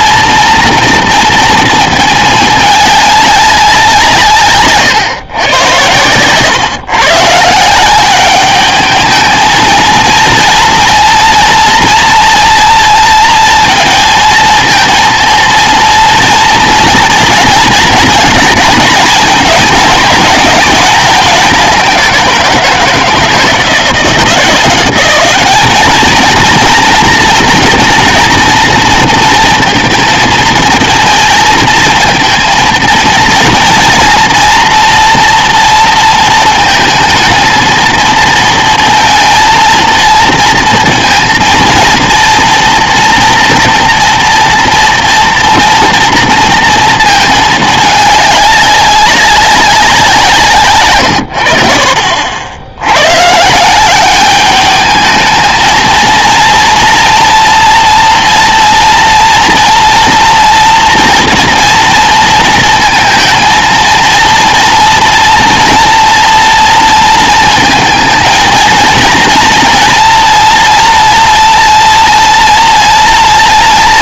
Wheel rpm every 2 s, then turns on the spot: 230, 210, 130, 130, 210, 230, 230, 230, 230, 240, 210, 170, 190, 230, 240, 220, 230, 230, 230, 230, 230, 230, 230, 230, 200, 130, 90, 210, 240, 230, 230, 230, 230, 230, 230, 230, 230.
none